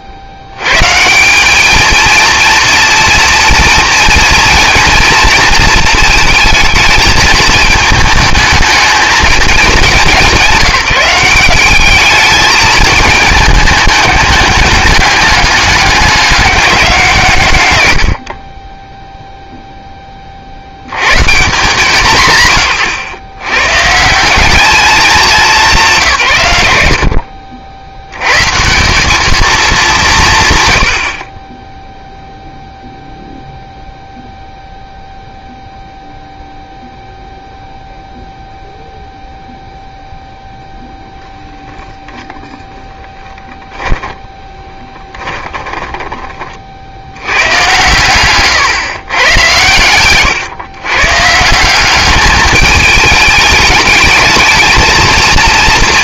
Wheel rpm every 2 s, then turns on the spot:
70, 230, 230, 220, 220, 170, 220, 210, 200, 30, 40, 130, 190, 120, 140, 170, 0, 0, 0, 0, 0, 0, 10, 50, 130, 130, 210, 220.
44-46